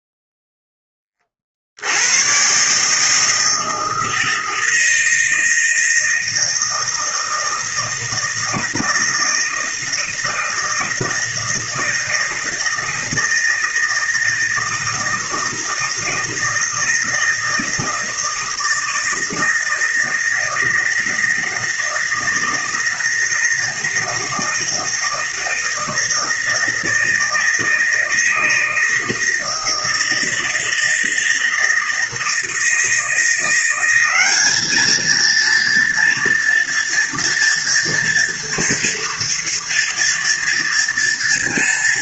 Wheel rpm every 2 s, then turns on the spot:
10, 140, 160, 160, 160, 160, 160, 160, 160, 160, 160, 160, 160, 160, 160, 160, 170, 210, 230, 230, 240.
none